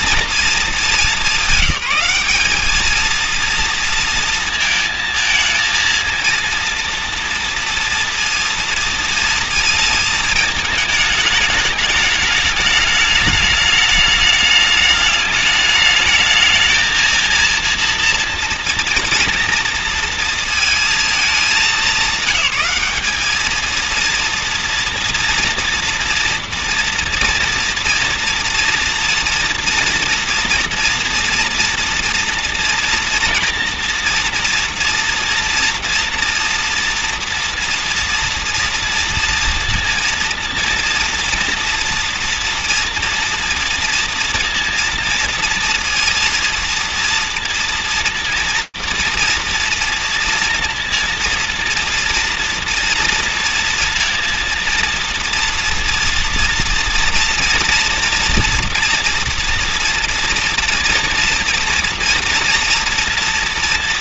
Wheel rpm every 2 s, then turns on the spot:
220, 210, 230, 230, 230, 220, 210, 210, 220, 240, 230, 200, 240, 230, 230, 240, 230, 230, 230, 240, 230, 240, 230, 230, 230, 230, 230, 230, 230, 230, 230, 230.
none